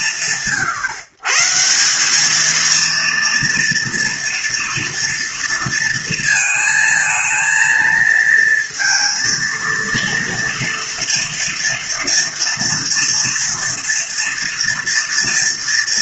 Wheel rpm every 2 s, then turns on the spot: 140, 230, 230, 220, 230, 230, 230, 230.
none